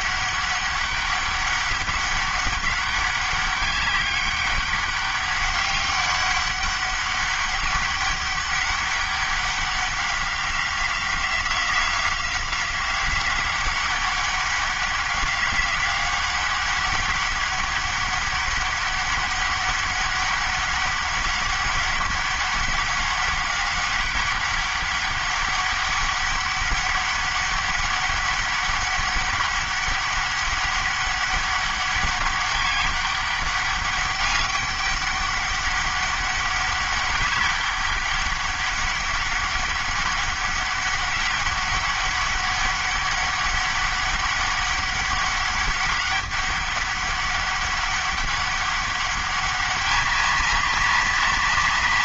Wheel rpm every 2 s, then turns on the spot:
200, 200, 200, 200, 200, 190, 180, 190, 190, 200, 200, 200, 190, 200, 200, 200, 200, 200, 200, 200, 200, 200, 200, 200, 200, 220.
none